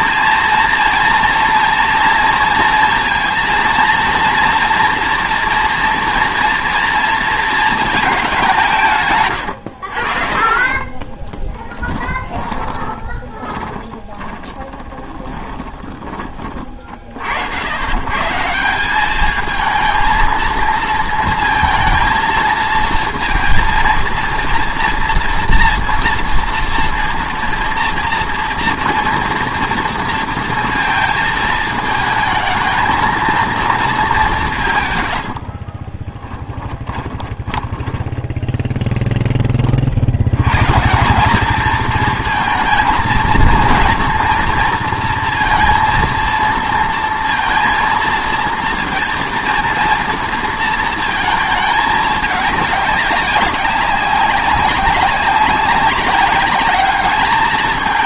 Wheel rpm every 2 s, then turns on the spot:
230, 230, 230, 230, 170, 30, 20, 20, 40, 170, 230, 230, 240, 230, 230, 230, 220, 150, 20, 10, 140, 220, 230, 230, 230, 230, 200, 200, 210.
10-16 36-38